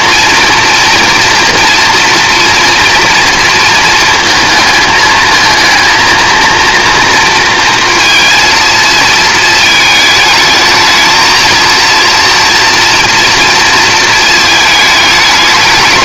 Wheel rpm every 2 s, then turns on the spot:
230, 230, 220, 230, 230, 220, 230, 220.
none